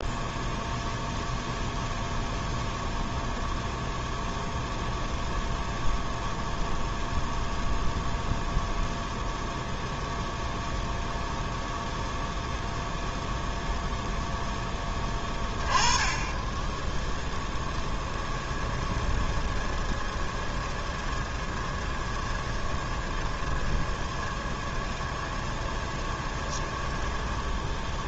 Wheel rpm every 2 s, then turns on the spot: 0, 0, 0, 0, 0, 0, 0, 10, 10, 10, 20, 20, 20, 10.
18-28